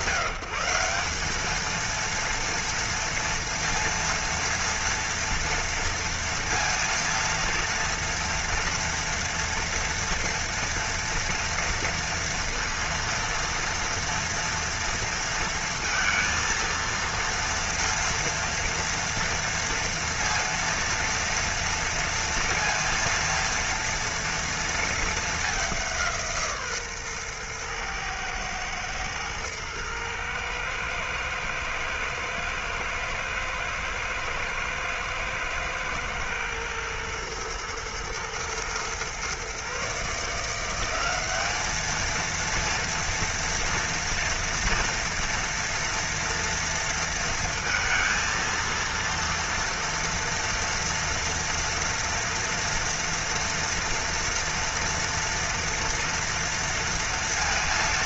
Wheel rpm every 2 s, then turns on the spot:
180, 230, 230, 230, 230, 230, 230, 230, 230, 230, 230, 230, 230, 150, 110, 110, 110, 110, 110, 120, 190, 230, 240, 230, 230, 230, 230, 230, 230.
none